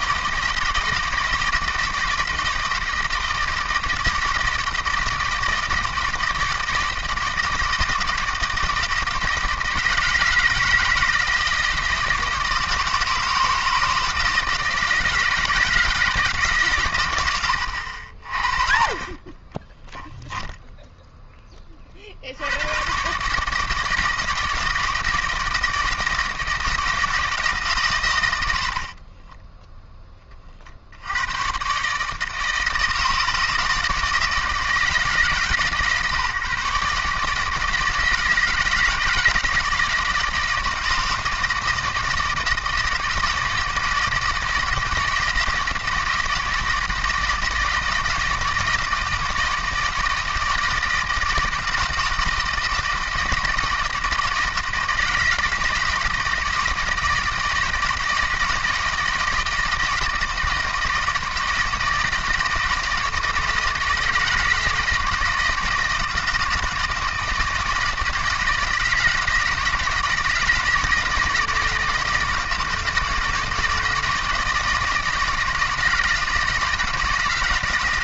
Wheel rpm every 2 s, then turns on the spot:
160, 160, 160, 160, 160, 160, 160, 160, 130, 40, 0, 110, 160, 160, 60, 60, 160, 150, 140, 160, 160, 160, 160, 160, 160, 160, 160, 160, 160, 160, 160, 160, 160, 160, 160, 160, 160, 160, 160.
28-30